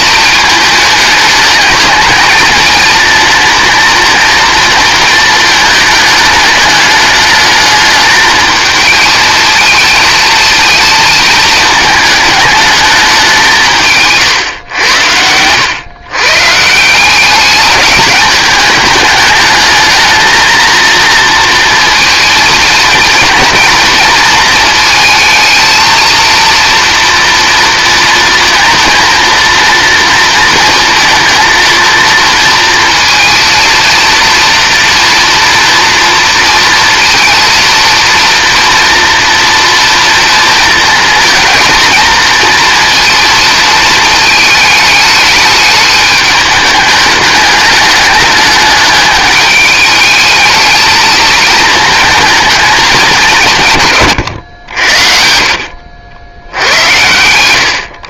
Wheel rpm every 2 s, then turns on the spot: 220, 220, 230, 210, 220, 230, 220, 120, 160, 210, 220, 230, 220, 230, 230, 230, 230, 230, 230, 240, 230, 230, 210, 210, 210, 220, 210, 80, 90.
none